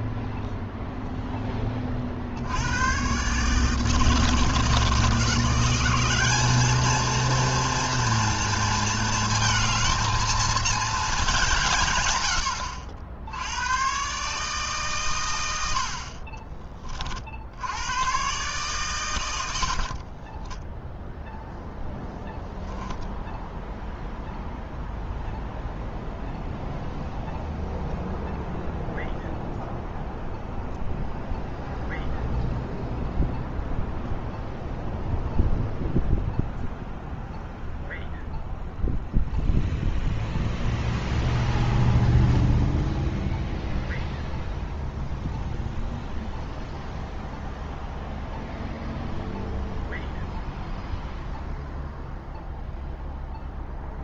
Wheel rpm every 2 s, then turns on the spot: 0, 90, 160, 220, 230, 220, 80, 140, 30, 140, 20, 0, 0, 0, 0, 0, 0, 0, 0, 0, 0, 0, 0, 0, 0, 0, 0.
20-22